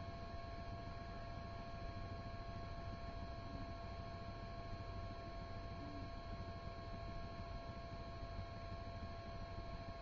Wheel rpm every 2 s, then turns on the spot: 0, 0, 0, 0, 0.
none